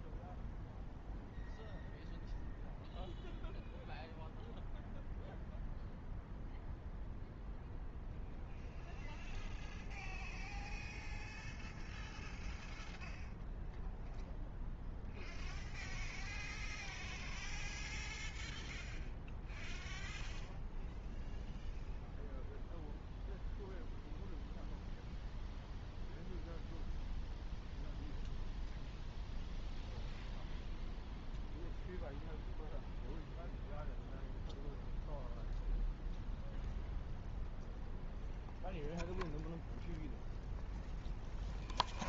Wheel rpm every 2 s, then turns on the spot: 0, 0, 0, 0, 0, 0, 0, 0, 0, 0, 0, 0, 0, 0, 0, 0, 0, 0, 0, 0, 0.
none